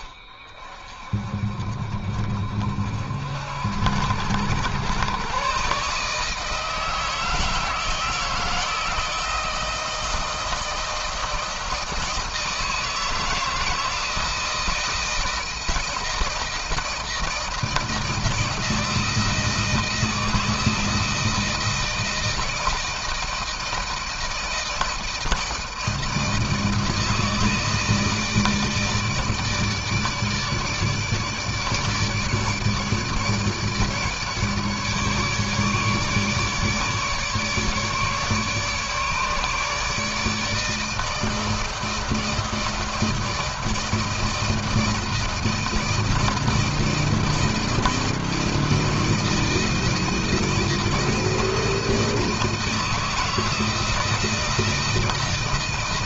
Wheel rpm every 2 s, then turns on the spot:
30, 50, 100, 160, 160, 160, 160, 160, 160, 160, 160, 160, 160, 160, 160, 150, 150, 150, 150, 150, 160, 160, 160, 160, 160, 160, 160, 160.
none